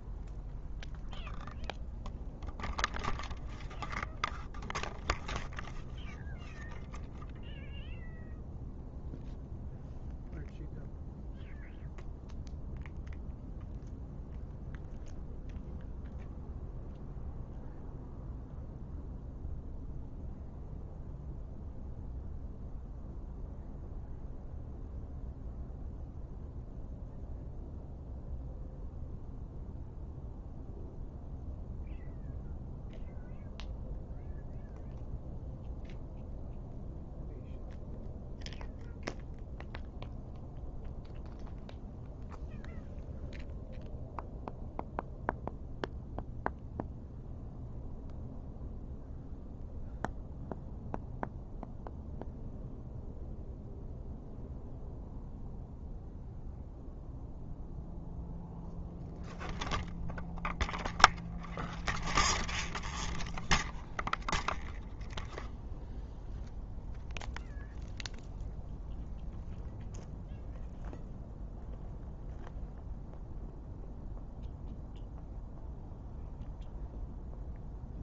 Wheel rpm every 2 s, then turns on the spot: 0, 0, 0, 0, 0, 0, 0, 0, 0, 0, 0, 0, 0, 0, 0, 0, 0, 0, 0, 0, 0, 0, 0, 0, 0, 0, 0, 0, 0, 0, 0, 0, 0, 0, 0, 0, 0, 0, 0.
none